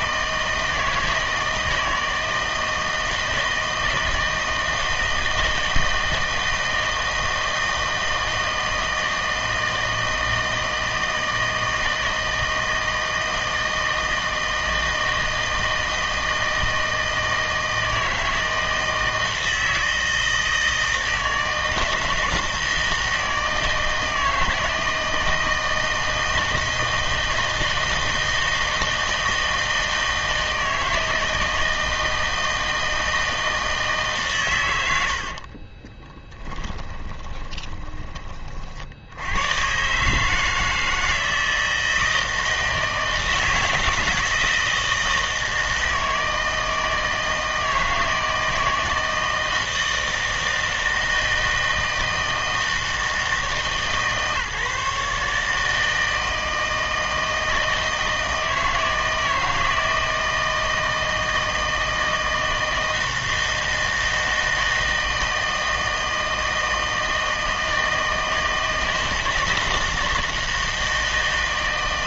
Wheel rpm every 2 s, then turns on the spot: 160, 160, 160, 160, 160, 160, 160, 160, 160, 160, 160, 160, 160, 160, 160, 160, 160, 110, 20, 40, 160, 160, 160, 160, 160, 160, 160, 150, 160, 160, 160, 160, 160, 160, 160, 160.
36-38